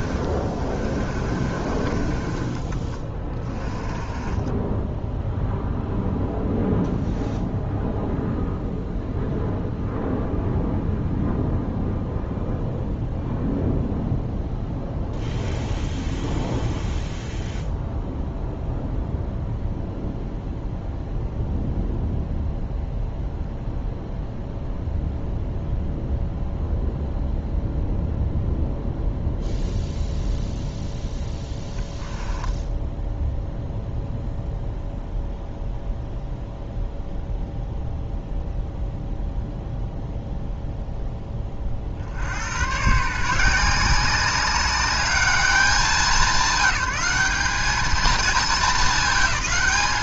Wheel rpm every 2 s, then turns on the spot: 30, 20, 10, 0, 0, 0, 0, 0, 0, 0, 0, 0, 0, 0, 0, 0, 10, 0, 0, 0, 0, 120, 200, 190, 220.
0-6 32-34